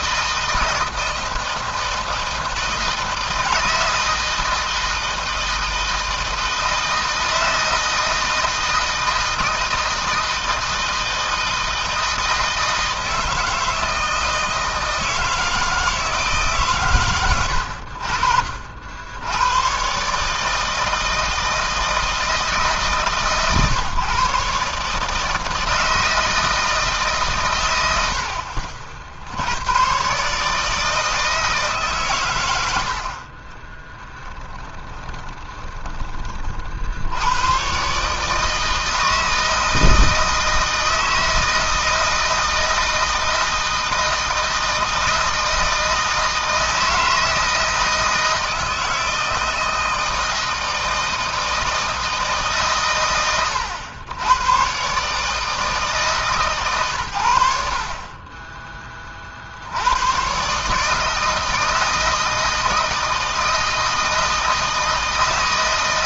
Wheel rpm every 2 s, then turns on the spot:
160, 160, 160, 160, 160, 160, 160, 160, 120, 70, 160, 150, 140, 150, 70, 160, 70, 20, 70, 160, 160, 160, 160, 160, 160, 160, 130, 130, 130, 30, 150, 160, 160.
32-36